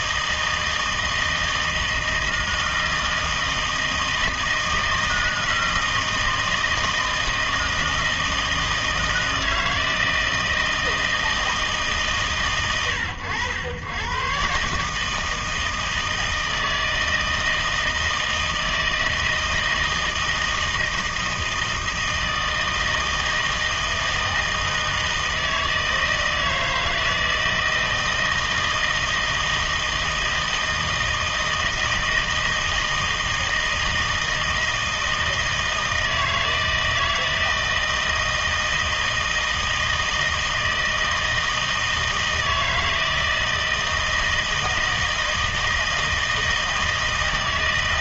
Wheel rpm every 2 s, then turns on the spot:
160, 160, 160, 160, 160, 160, 110, 140, 160, 160, 160, 160, 160, 160, 160, 160, 160, 160, 160, 160, 160, 160, 160, 160.
none